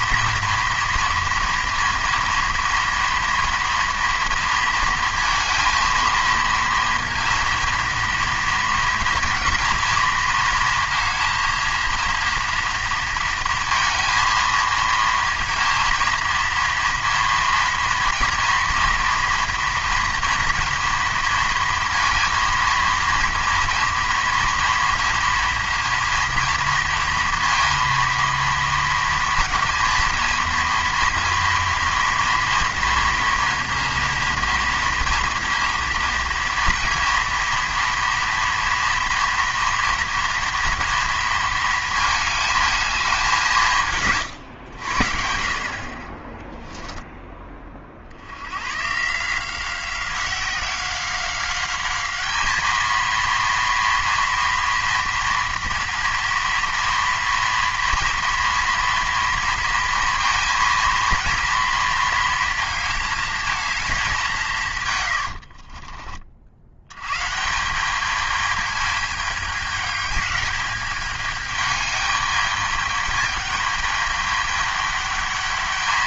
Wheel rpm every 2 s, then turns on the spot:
240, 230, 230, 230, 230, 230, 230, 220, 230, 230, 230, 230, 230, 230, 230, 230, 230, 230, 230, 230, 230, 220, 110, 10, 110, 180, 220, 230, 230, 230, 230, 230, 170, 50, 210, 210, 210, 210.
46-48